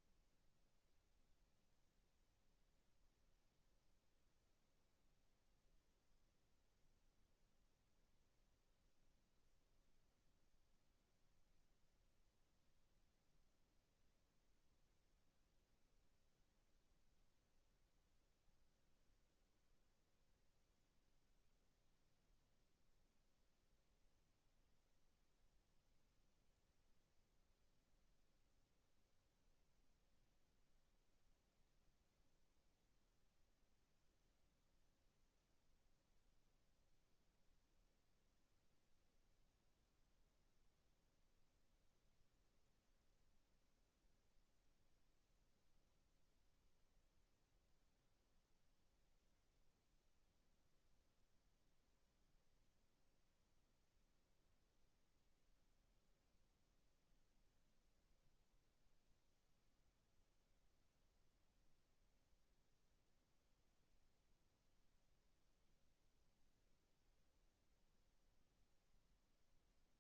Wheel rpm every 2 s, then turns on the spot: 0, 0, 0, 0, 0, 0, 0, 0, 0, 0, 0, 0, 0, 0, 0, 0, 0, 0, 0, 0, 0, 0, 0, 0, 0, 0, 0, 0, 0, 0, 0, 0, 0, 0, 0.
none